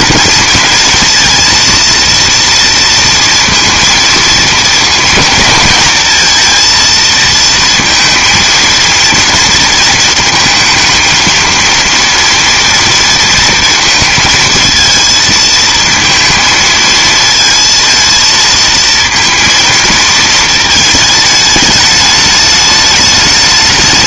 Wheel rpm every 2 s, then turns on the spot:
230, 230, 230, 230, 230, 230, 230, 220, 230, 230, 220, 210.
none